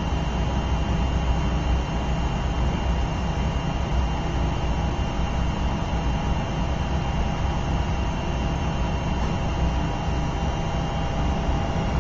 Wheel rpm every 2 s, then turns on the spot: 0, 0, 0, 0, 0, 0.
none